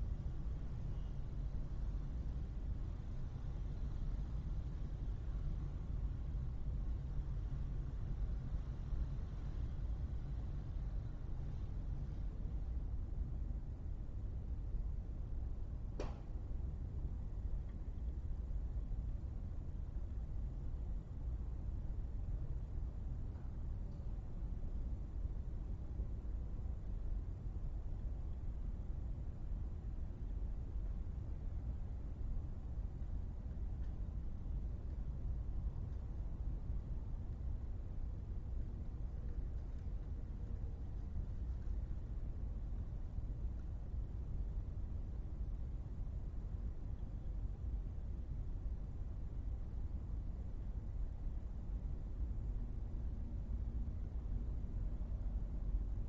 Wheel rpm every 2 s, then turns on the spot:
0, 0, 0, 0, 0, 0, 0, 0, 0, 0, 0, 0, 0, 0, 0, 0, 0, 0, 0, 0, 0, 0, 0, 0, 0, 0, 0, 0.
none